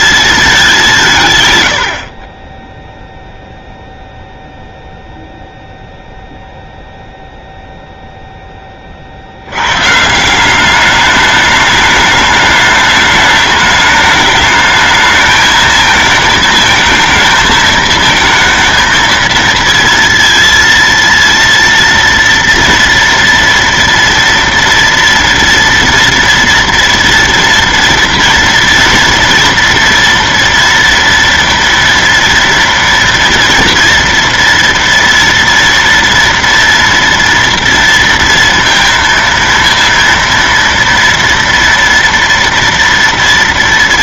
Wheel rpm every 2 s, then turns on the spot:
210, 20, 0, 0, 10, 190, 210, 210, 220, 230, 230, 230, 230, 230, 240, 230, 230, 240, 240, 230, 230, 230.
none